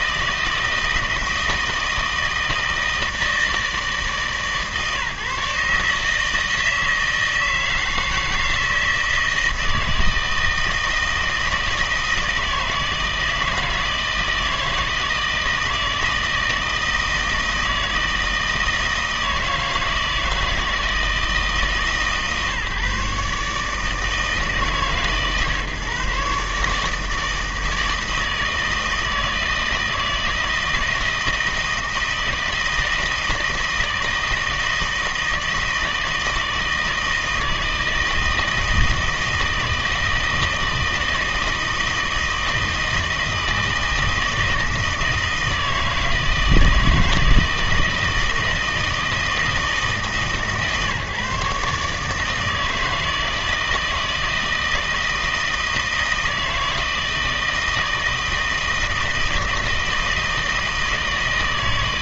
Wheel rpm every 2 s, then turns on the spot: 160, 160, 150, 160, 160, 160, 160, 160, 160, 160, 160, 140, 150, 150, 160, 160, 160, 160, 160, 160, 160, 160, 160, 160, 160, 140, 160, 160, 160, 160, 160.
none